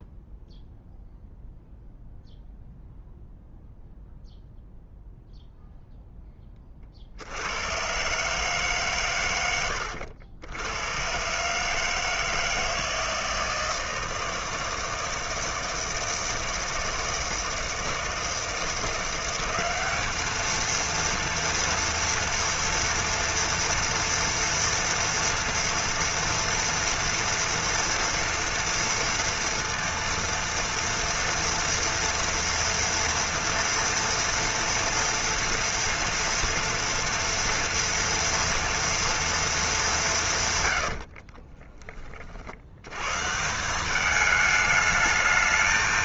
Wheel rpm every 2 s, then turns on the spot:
0, 0, 0, 40, 140, 100, 160, 160, 160, 170, 230, 230, 230, 230, 230, 230, 230, 230, 230, 230, 110, 80, 210.
40-42